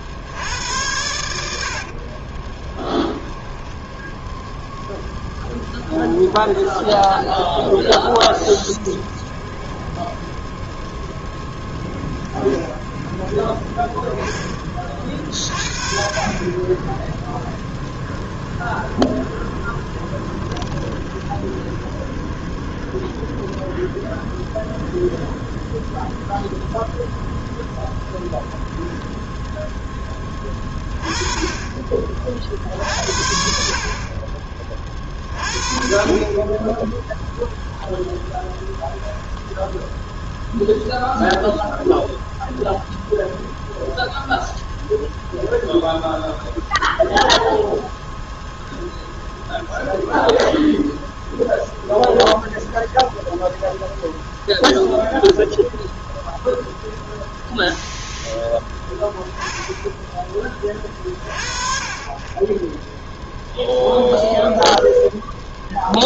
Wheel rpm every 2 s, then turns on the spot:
100, 20, 0, 0, 0, 0, 10, 20, 20, 10, 20, 10, 0, 0, 0, 20, 60, 40, 10, 0, 0, 0, 0, 0, 0, 0, 0, 0, 0, 10, 30, 0, 0.
2-4 18-24